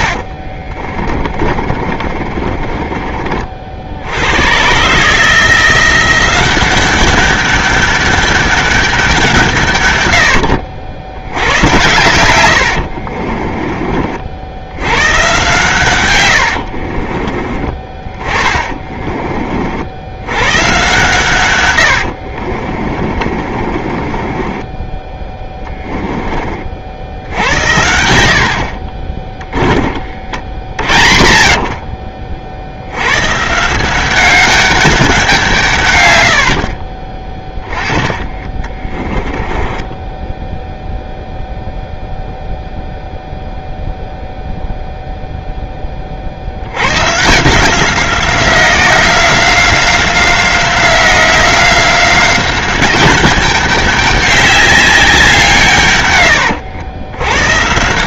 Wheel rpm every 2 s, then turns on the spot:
50, 30, 130, 190, 200, 80, 80, 100, 50, 30, 130, 40, 10, 50, 30, 50, 100, 200, 50, 20, 0, 0, 0, 110, 180, 180, 200, 190, 120.
0-2 12-14 16-18 20-26 36-40